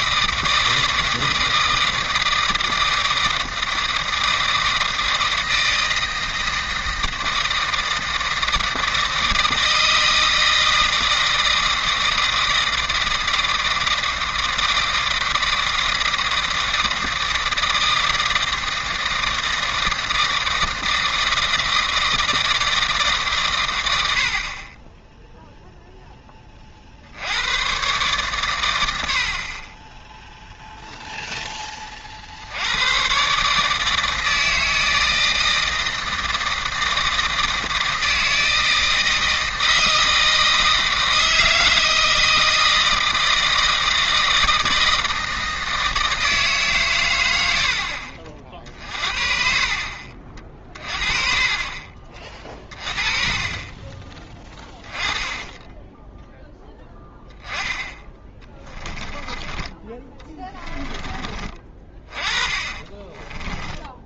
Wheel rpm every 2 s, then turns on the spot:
160, 160, 160, 160, 160, 160, 160, 160, 160, 160, 160, 160, 30, 50, 100, 0, 90, 160, 160, 160, 160, 160, 160, 140, 40, 30, 30, 20, 10, 10, 20, 30.
52-56 58-64